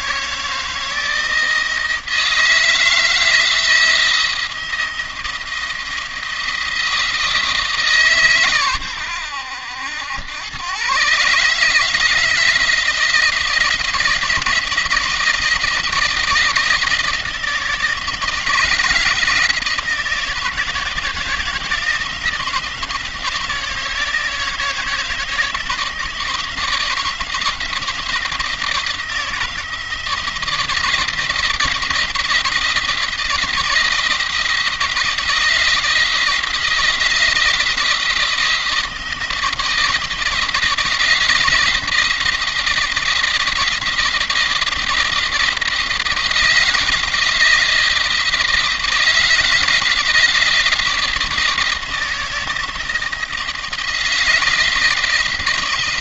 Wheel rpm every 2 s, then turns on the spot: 160, 160, 170, 170, 110, 120, 160, 170, 170, 160, 170, 160, 160, 160, 160, 160, 170, 170, 170, 160, 160, 170, 170, 170, 160, 160, 170, 160.
none